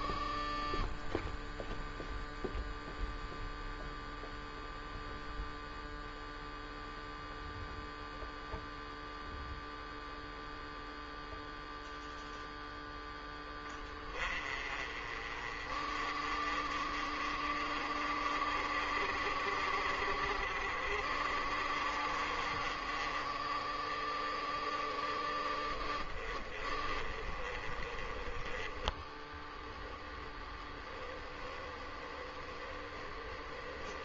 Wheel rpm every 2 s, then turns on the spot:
0, 0, 0, 0, 0, 0, 10, 30, 40, 40, 40, 30, 20, 20, 10, 10, 10.
28-30